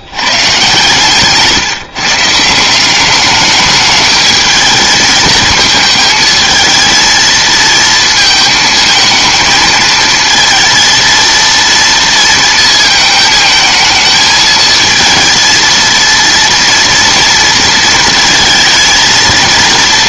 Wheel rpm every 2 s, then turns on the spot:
120, 170, 220, 230, 220, 230, 230, 220, 230, 230.
none